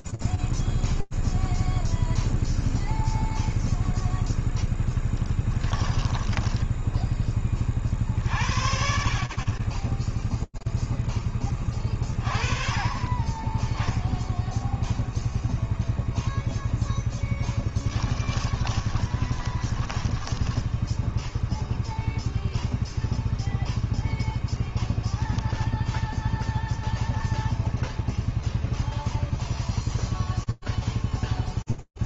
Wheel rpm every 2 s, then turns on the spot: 0, 0, 0, 10, 50, 10, 20, 0, 10, 20, 0, 0, 0, 0, 0, 0.
6-8 16-20